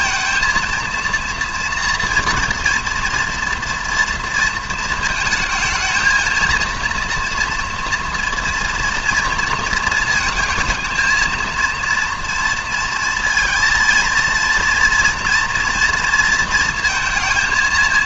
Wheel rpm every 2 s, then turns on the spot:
230, 230, 230, 230, 230, 220, 230, 230, 230.
none